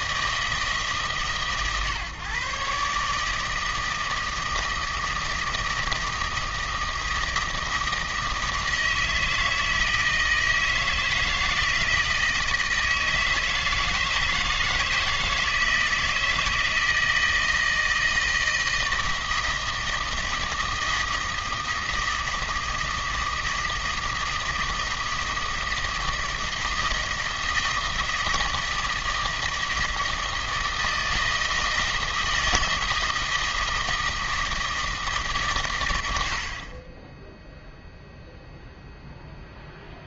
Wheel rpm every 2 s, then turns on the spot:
140, 160, 160, 160, 160, 160, 160, 160, 160, 160, 160, 160, 160, 160, 160, 160, 160, 160, 20, 0.
none